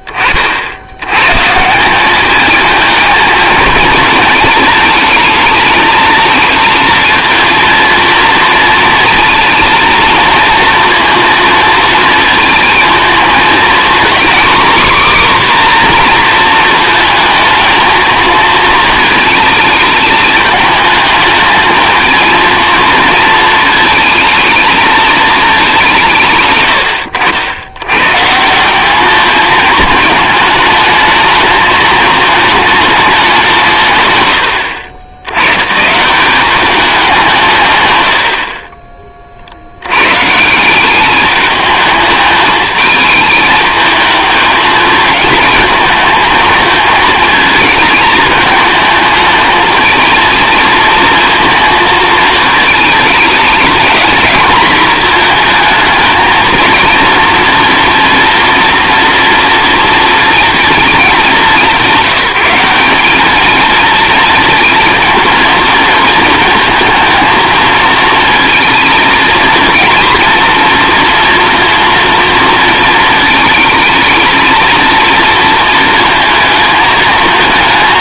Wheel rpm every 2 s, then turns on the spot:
80, 220, 220, 230, 230, 230, 220, 260, 230, 220, 210, 220, 220, 110, 190, 220, 210, 80, 200, 40, 180, 210, 220, 220, 220, 230, 220, 230, 230, 240, 220, 190, 230, 230, 230, 240, 230, 230, 220.
none